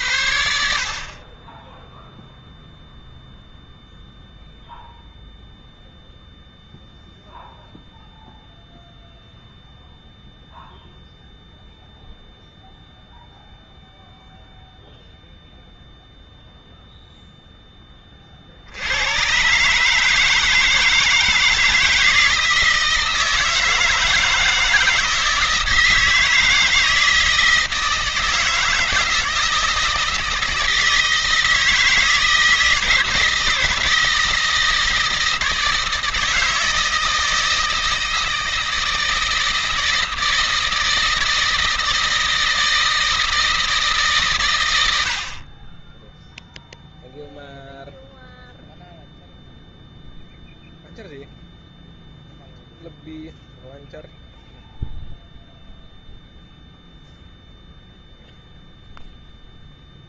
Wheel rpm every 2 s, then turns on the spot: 60, 0, 0, 0, 0, 0, 0, 0, 0, 90, 160, 160, 160, 160, 160, 160, 160, 160, 160, 160, 160, 160, 90, 0, 0, 0, 0, 0, 0, 0.
none